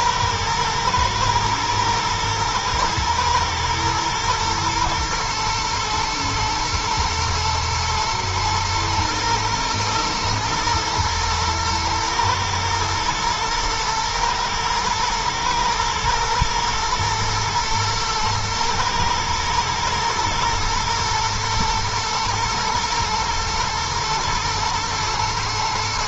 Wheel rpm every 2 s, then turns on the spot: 110, 110, 120, 110, 110, 120, 110, 110, 110, 110, 110, 120, 120.
none